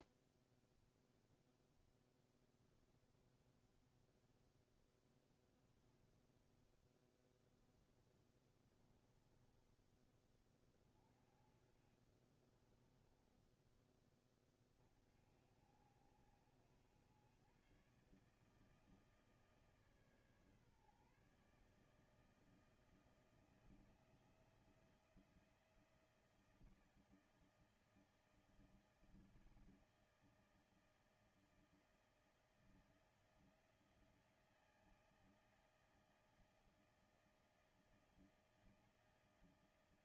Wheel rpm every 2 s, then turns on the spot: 0, 10, 0, 0, 10, 30, 20, 40, 100, 160, 150, 160, 170, 170, 160, 160, 160, 160, 160, 160.
8-10 12-14